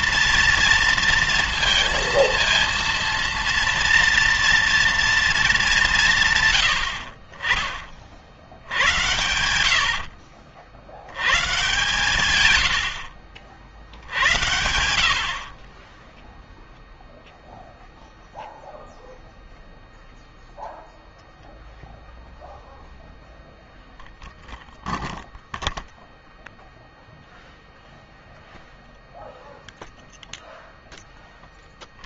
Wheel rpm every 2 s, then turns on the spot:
230, 230, 230, 90, 90, 80, 80, 60, 0, 0, 0, 0, 0, 0, 0, 0.
none